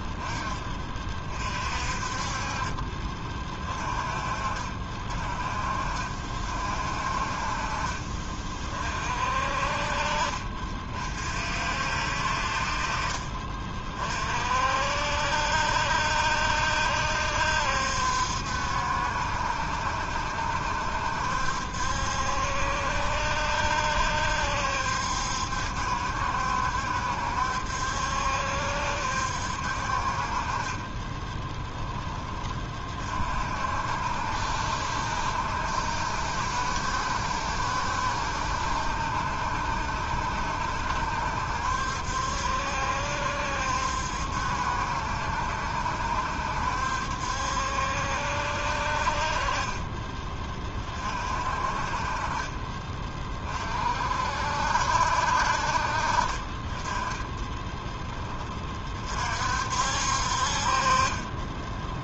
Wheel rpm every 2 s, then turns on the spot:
20, 30, 50, 50, 40, 40, 50, 50, 70, 70, 70, 70, 70, 70, 70, 30, 30, 60, 70, 70, 70, 70, 70, 70, 60, 30, 30, 60, 20, 30, 40.
30-32